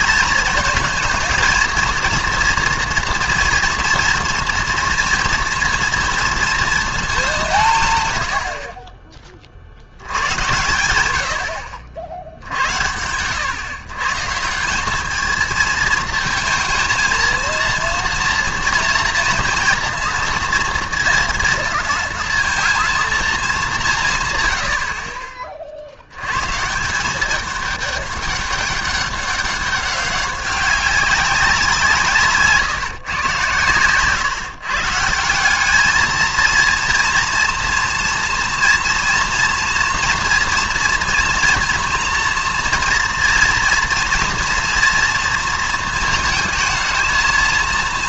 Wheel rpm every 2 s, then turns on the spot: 220, 230, 230, 230, 50, 110, 90, 190, 230, 230, 230, 230, 70, 160, 200, 190, 140, 140, 230, 230, 230, 230, 230, 220.
none